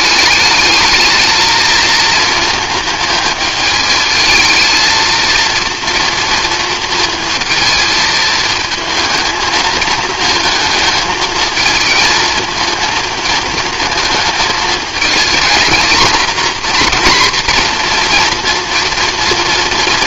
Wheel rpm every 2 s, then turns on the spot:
220, 220, 220, 230, 220, 220, 230, 220, 240, 240.
none